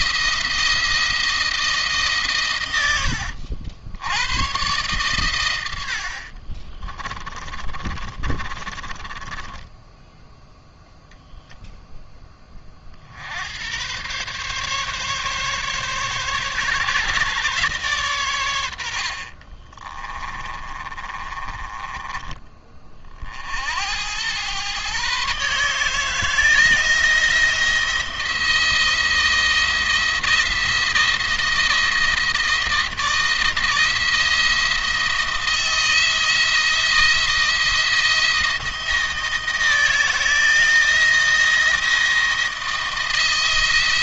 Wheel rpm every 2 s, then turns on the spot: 170, 110, 120, 40, 30, 10, 40, 140, 140, 100, 20, 30, 120, 160, 170, 170, 160, 170, 170, 160, 160, 160.
6-10 20-22